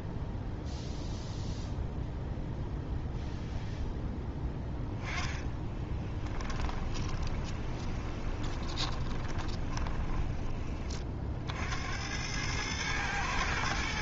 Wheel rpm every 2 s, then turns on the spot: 0, 0, 10, 20, 20, 40, 110.
4-10